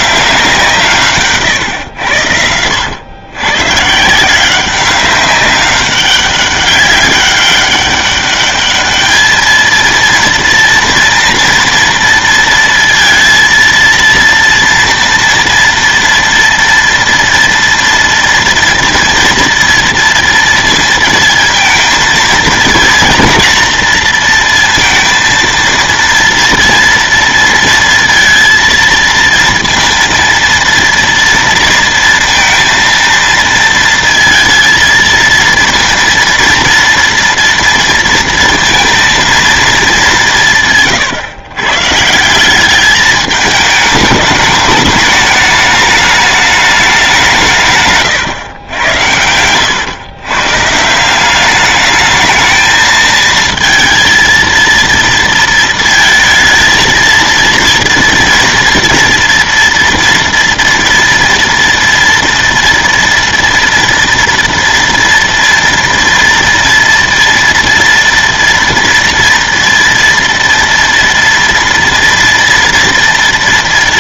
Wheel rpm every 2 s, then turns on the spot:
160, 90, 190, 200, 210, 230, 230, 230, 230, 230, 230, 220, 230, 230, 230, 230, 230, 230, 230, 230, 140, 210, 210, 200, 110, 160, 220, 230, 230, 230, 230, 230, 230, 230, 230, 230, 230.
none